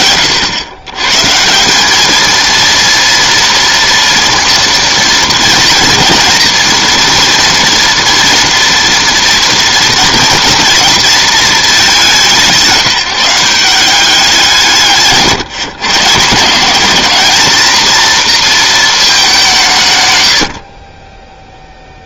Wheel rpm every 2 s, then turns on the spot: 130, 230, 230, 230, 230, 230, 170, 160, 210, 210, 20.
none